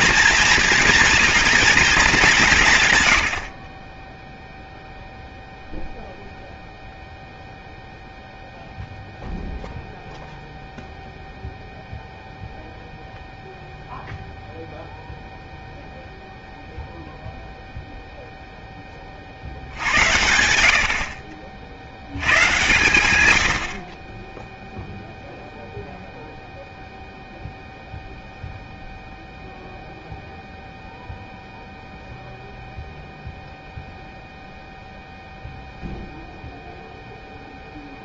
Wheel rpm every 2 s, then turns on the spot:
230, 170, 0, 0, 0, 0, 0, 0, 0, 10, 70, 120, 0, 0, 0, 0, 0, 0, 0.
none